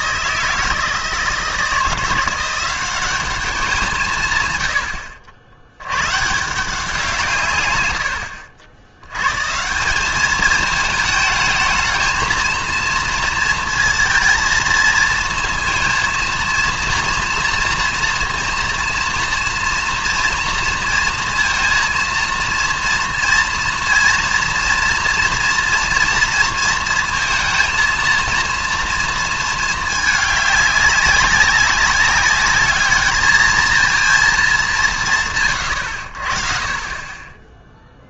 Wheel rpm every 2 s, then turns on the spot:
160, 190, 100, 160, 90, 210, 220, 230, 230, 230, 230, 230, 230, 230, 230, 200, 210, 200, 30.
none